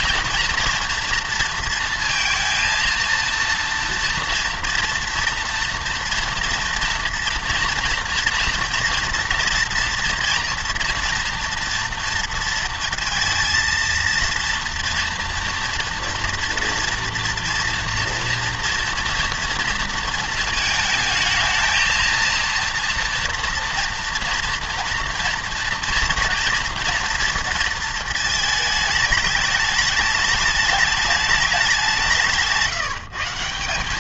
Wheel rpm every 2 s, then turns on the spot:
230, 230, 230, 240, 230, 230, 230, 230, 230, 230, 220, 230, 230, 230, 220, 210, 160.
none